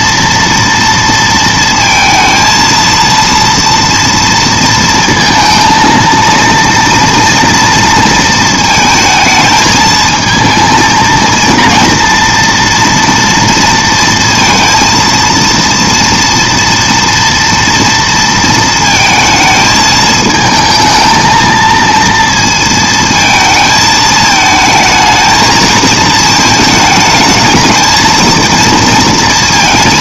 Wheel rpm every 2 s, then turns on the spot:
230, 230, 230, 230, 220, 220, 230, 230, 230, 230, 220, 230, 220, 220, 230.
none